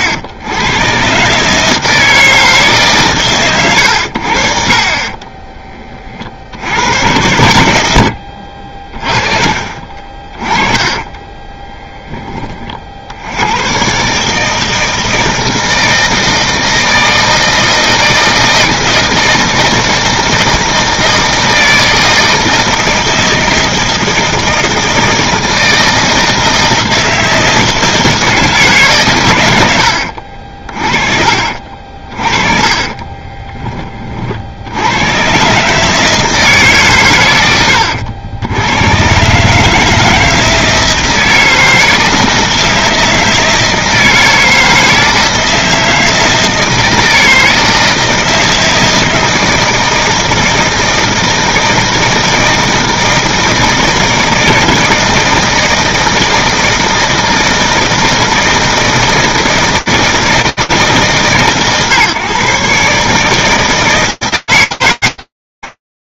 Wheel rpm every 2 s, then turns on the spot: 160, 110, 20, 90, 40, 20, 80, 160, 160, 160, 160, 160, 160, 160, 100, 40, 20, 120, 110, 140, 160, 160, 160, 160, 160, 160, 160, 160, 160, 160, 150, 160, 100.
10-12 32-34